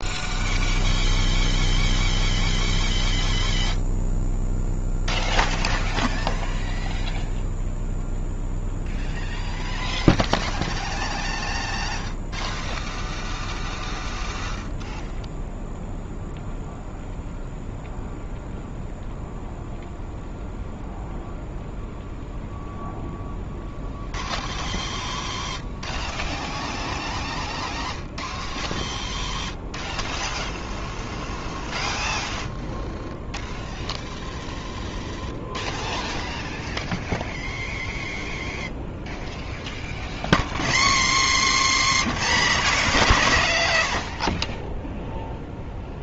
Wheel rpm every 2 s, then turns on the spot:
0, 0, 0, 0, 0, 0, 0, 0, 0, 0, 0, 0, 0, 0, 0, 0, 0, 0, 0, 0, 30, 140, 0.
none